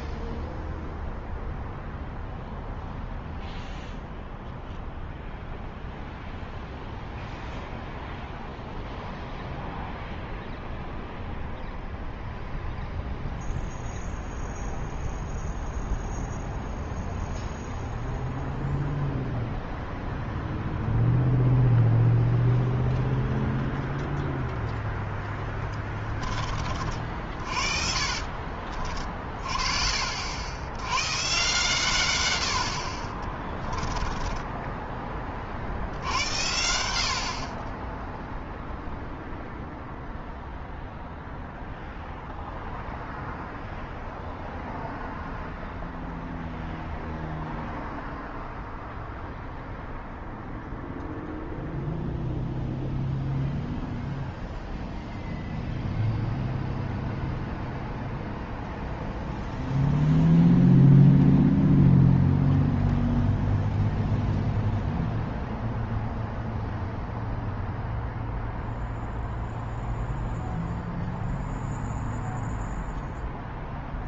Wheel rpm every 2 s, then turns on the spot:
0, 0, 0, 0, 0, 0, 0, 0, 0, 0, 0, 0, 10, 50, 40, 130, 30, 40, 40, 0, 0, 0, 0, 0, 0, 0, 0, 0, 0, 0, 0, 0, 0, 0, 0, 0, 0.
24-28 32-34